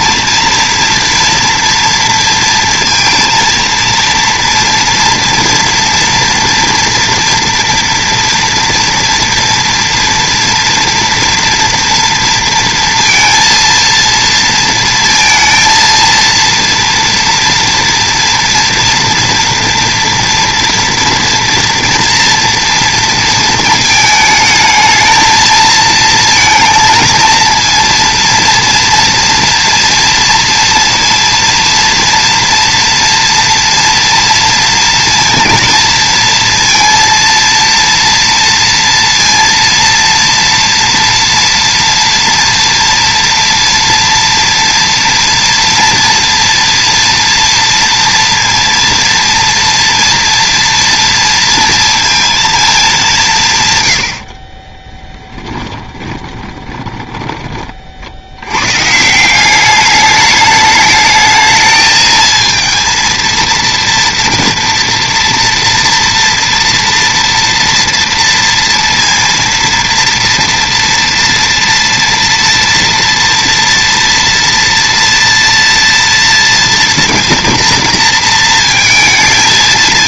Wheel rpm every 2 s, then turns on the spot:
230, 230, 230, 230, 230, 230, 230, 230, 230, 230, 230, 230, 220, 220, 230, 230, 230, 230, 230, 230, 230, 230, 230, 230, 230, 230, 220, 40, 20, 110, 210, 230, 230, 230, 230, 230, 230, 240, 230, 230.
54-58